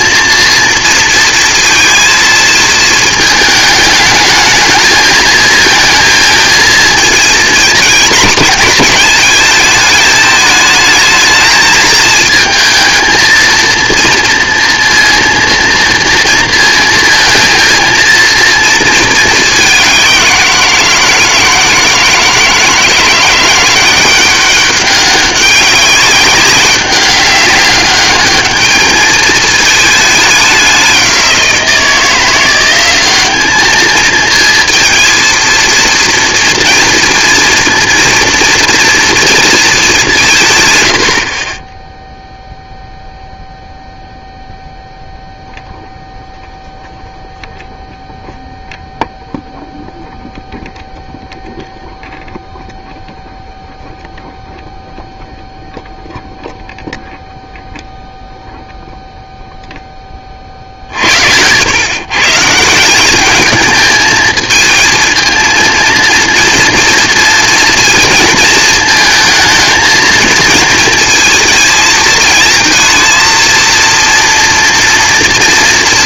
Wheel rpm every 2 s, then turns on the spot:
230, 230, 220, 220, 220, 220, 220, 230, 230, 230, 170, 160, 200, 200, 210, 190, 180, 230, 230, 230, 130, 0, 0, 0, 0, 0, 0, 0, 0, 0, 50, 170, 220, 230, 220, 230, 230, 230.
none